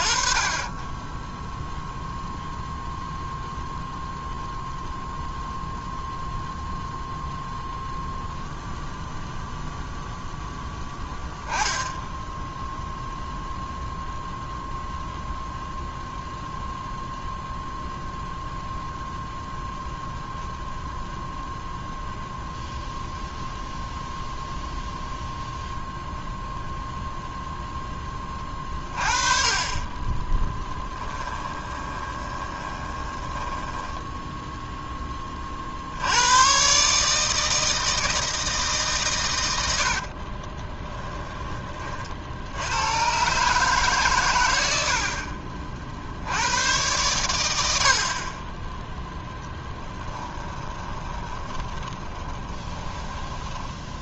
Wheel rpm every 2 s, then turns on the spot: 20, 0, 0, 0, 0, 10, 0, 0, 0, 0, 0, 0, 0, 0, 40, 10, 20, 10, 140, 140, 20, 90, 80, 110, 10, 20, 10.
28-34 40-42 44-46 50-54